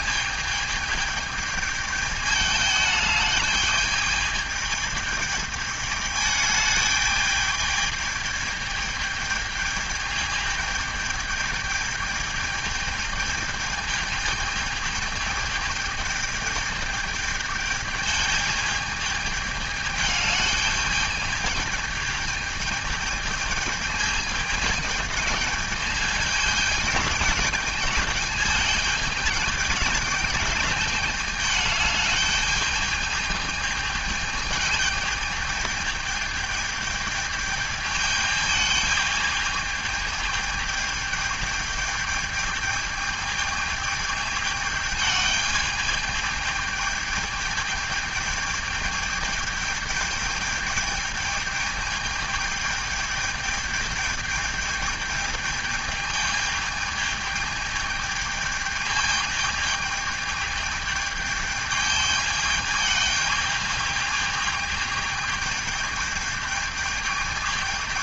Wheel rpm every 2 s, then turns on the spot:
220, 210, 210, 210, 210, 210, 210, 220, 220, 210, 210, 220, 210, 210, 210, 210, 210, 210, 220, 210, 220, 210, 210, 210, 210, 220, 220, 210, 210, 210, 210, 210, 210, 210.
none